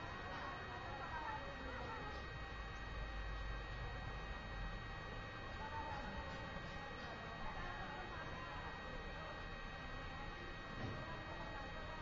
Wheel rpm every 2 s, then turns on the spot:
0, 0, 0, 0, 0, 0.
none